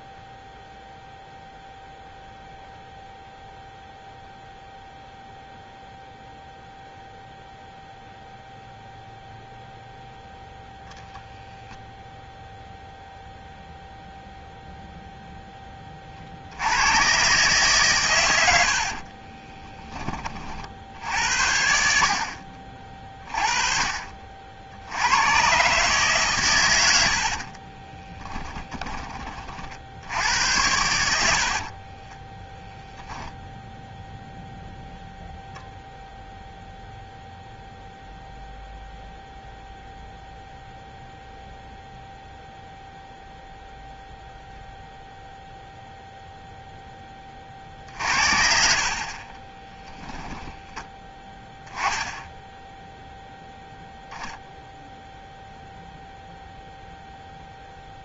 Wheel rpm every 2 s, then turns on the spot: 0, 0, 0, 0, 0, 0, 0, 0, 70, 90, 40, 50, 50, 120, 10, 90, 10, 0, 0, 0, 0, 0, 0, 0, 60, 10, 0, 0, 0.
28-30 32-34